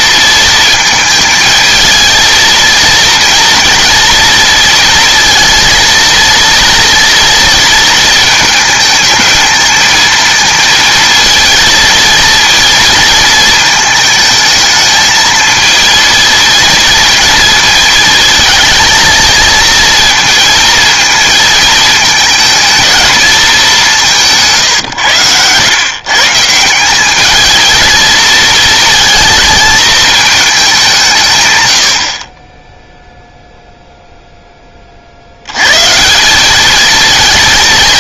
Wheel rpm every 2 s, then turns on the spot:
220, 230, 230, 230, 220, 230, 230, 220, 230, 220, 230, 230, 130, 170, 230, 190, 10, 30, 220.
none